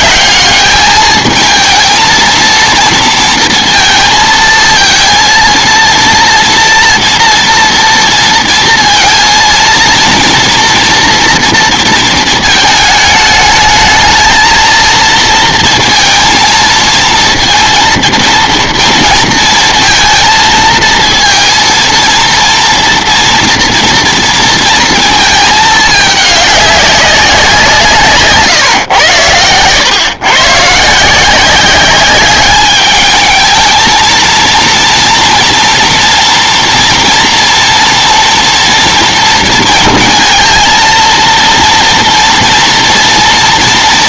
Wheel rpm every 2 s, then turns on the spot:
210, 230, 220, 230, 230, 230, 220, 230, 230, 230, 230, 240, 230, 190, 130, 150, 210, 230, 230, 230, 230, 240.
none